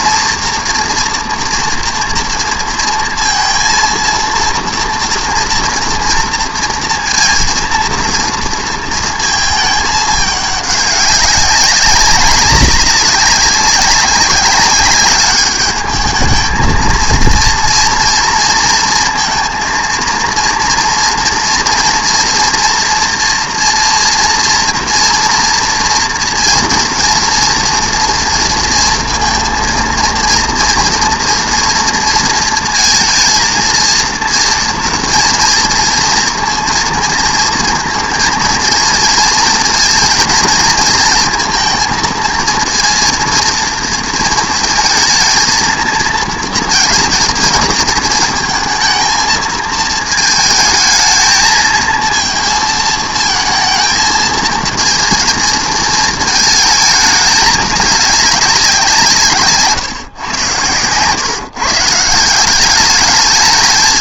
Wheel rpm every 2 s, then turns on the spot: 230, 230, 230, 230, 230, 200, 200, 200, 220, 230, 230, 230, 230, 230, 230, 230, 230, 230, 230, 230, 230, 230, 230, 230, 230, 220, 220, 220, 220, 190, 100, 190.
none